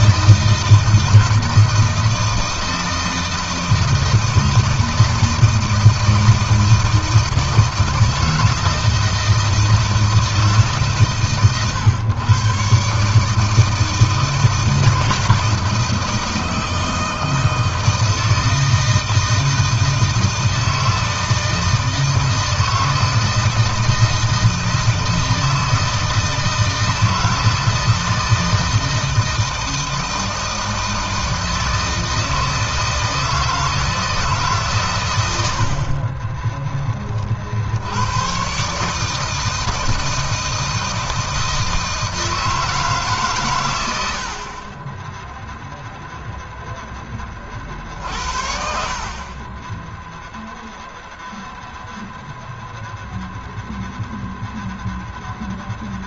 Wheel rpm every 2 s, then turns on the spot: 160, 160, 160, 160, 160, 160, 130, 160, 160, 160, 160, 160, 160, 160, 160, 160, 160, 150, 30, 120, 160, 160, 70, 0, 60, 0, 0, 0.
36-38